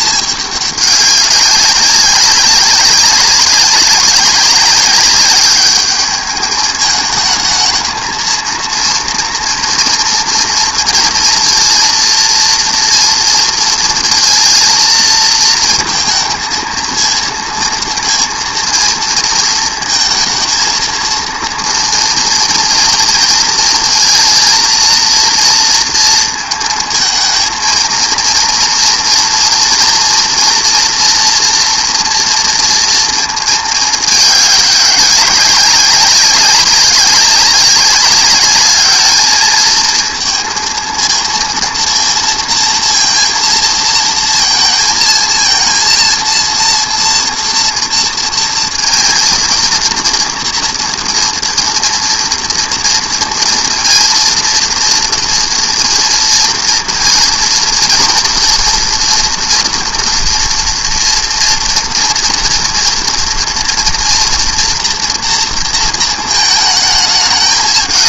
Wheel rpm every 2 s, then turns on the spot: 210, 200, 200, 210, 230, 230, 230, 230, 230, 230, 230, 240, 230, 230, 230, 230, 230, 200, 190, 200, 230, 230, 230, 230, 230, 230, 230, 230, 230, 230, 230, 230, 240, 220.
none